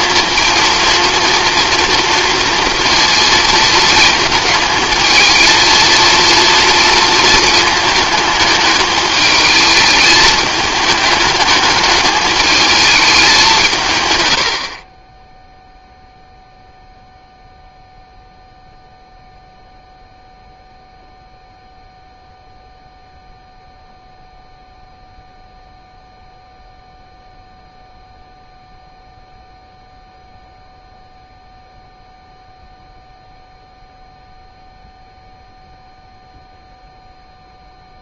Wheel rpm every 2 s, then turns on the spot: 230, 230, 220, 230, 220, 210, 210, 50, 0, 0, 0, 0, 0, 0, 0, 0, 0, 0, 0.
none